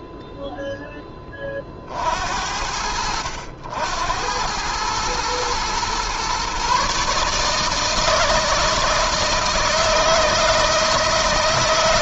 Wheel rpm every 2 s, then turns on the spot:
0, 80, 100, 130, 160, 160.
none